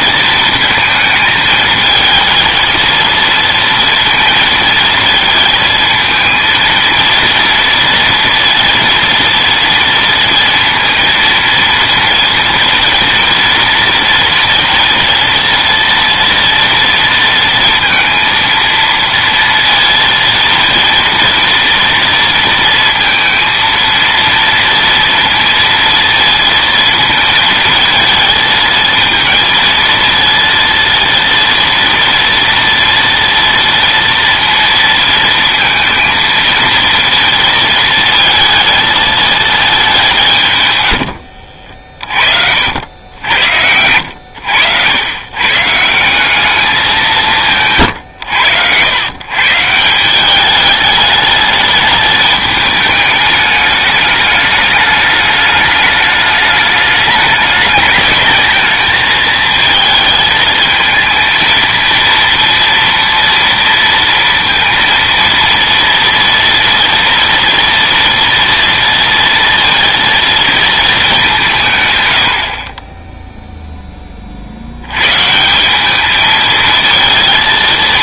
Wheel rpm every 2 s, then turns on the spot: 230, 230, 230, 230, 230, 230, 230, 230, 230, 230, 230, 230, 230, 230, 220, 230, 230, 230, 230, 220, 110, 70, 90, 200, 100, 210, 210, 210, 210, 220, 220, 230, 230, 230, 230, 220, 30, 80, 220.
none